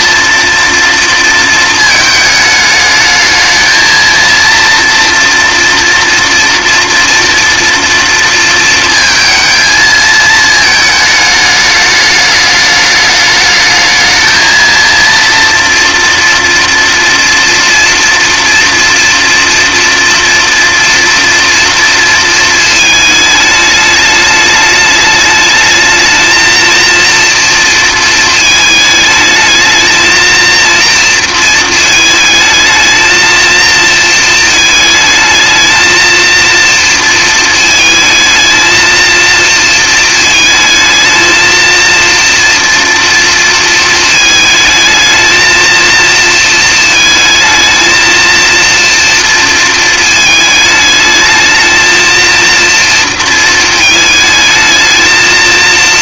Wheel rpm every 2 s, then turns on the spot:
230, 210, 230, 230, 220, 220, 210, 230, 240, 230, 230, 220, 210, 230, 220, 230, 220, 220, 230, 230, 220, 230, 220, 230, 230, 220, 230, 220.
none